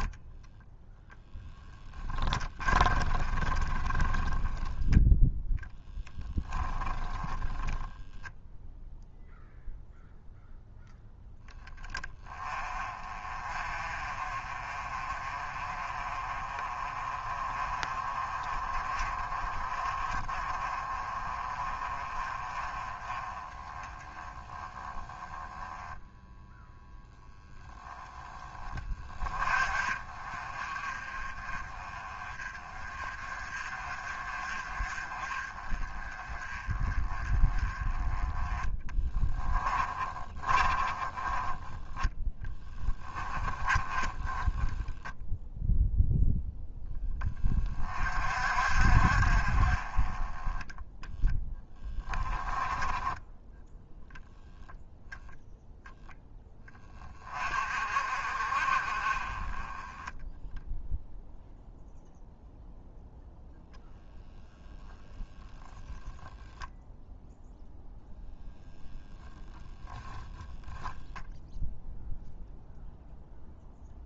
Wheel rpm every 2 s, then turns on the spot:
0, 20, 10, 10, 0, 0, 30, 30, 30, 30, 30, 20, 10, 0, 20, 30, 30, 30, 20, 10, 20, 20, 10, 10, 50, 10, 10, 0, 20, 30, 0, 0, 0, 0, 0, 0, 0.
2-4 6-8 38-46 50-54